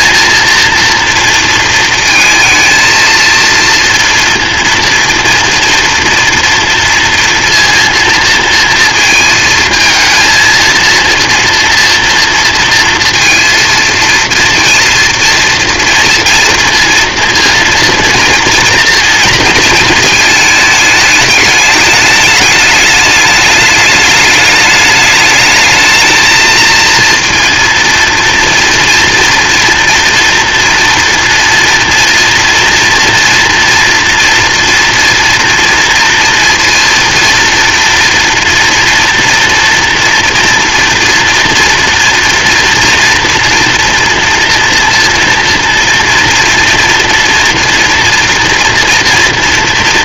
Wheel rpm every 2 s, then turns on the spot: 230, 230, 230, 240, 230, 230, 230, 230, 230, 230, 220, 210, 210, 230, 230, 240, 230, 230, 230, 240, 240, 230, 230, 230, 240.
none